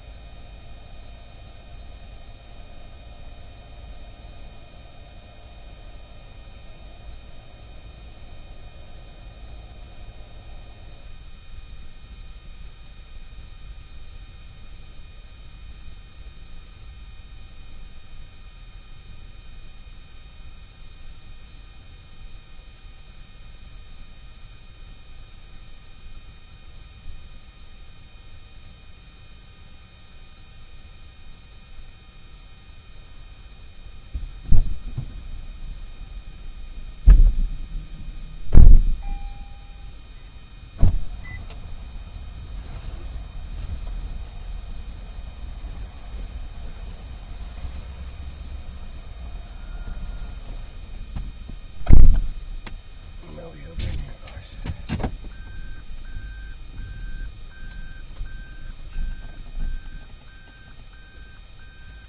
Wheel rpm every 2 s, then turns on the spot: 0, 0, 0, 0, 0, 0, 0, 0, 0, 0, 0, 0, 0, 0, 0, 0, 0, 0, 0, 0, 0, 0, 0, 0, 0, 0, 0, 0, 0, 0, 0.
none